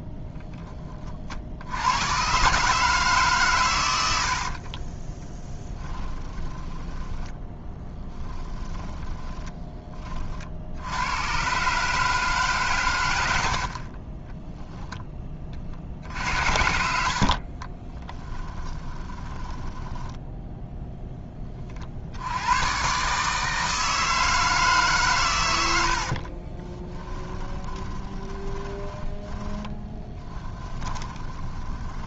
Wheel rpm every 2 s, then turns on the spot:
140, 30, 10, 10, 60, 140, 10, 60, 20, 10, 40, 160, 70, 20, 10, 20.
2-8 14-20 26-32